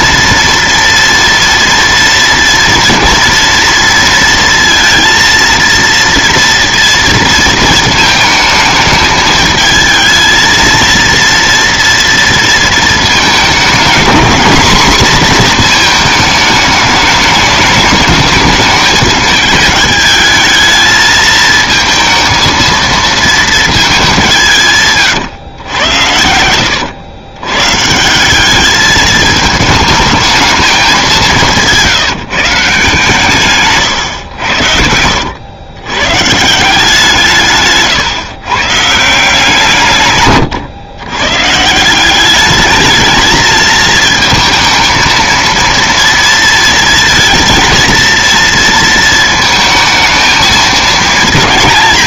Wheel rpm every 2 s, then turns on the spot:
240, 230, 230, 230, 220, 230, 230, 240, 210, 210, 220, 230, 150, 90, 210, 210, 150, 80, 160, 140, 120, 210, 230, 230, 230, 220.
none